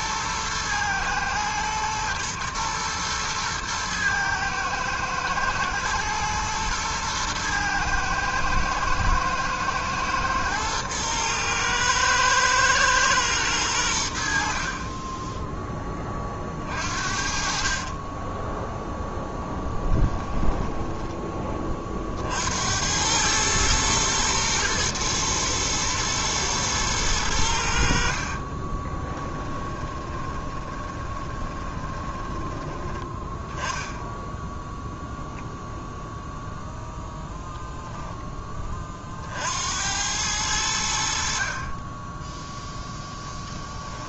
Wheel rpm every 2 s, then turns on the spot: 110, 110, 110, 110, 110, 110, 110, 30, 50, 0, 10, 90, 110, 110, 20, 20, 10, 0, 0, 40, 70, 0.
28-32